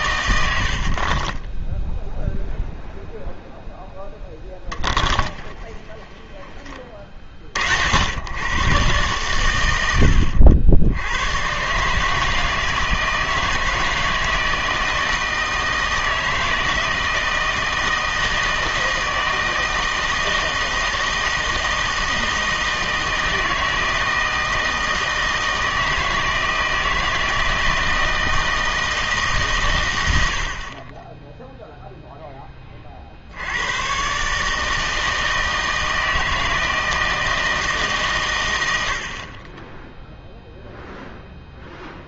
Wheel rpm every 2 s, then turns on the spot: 70, 0, 10, 20, 120, 80, 160, 160, 160, 160, 160, 160, 160, 160, 160, 40, 30, 150, 160, 80, 0.
0-2 4-6